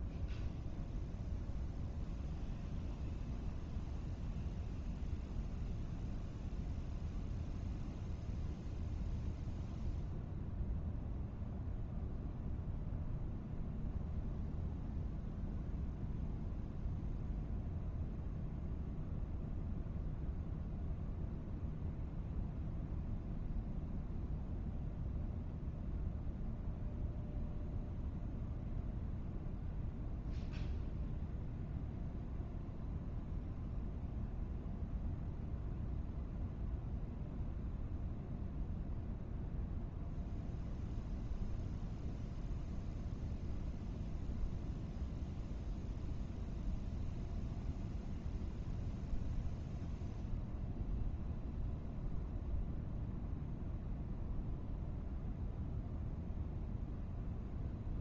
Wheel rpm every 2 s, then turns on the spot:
0, 0, 0, 0, 0, 0, 0, 0, 0, 0, 0, 0, 0, 0, 0, 0, 0, 0, 0, 0, 0, 0, 0, 0, 0, 0, 0, 0, 0.
none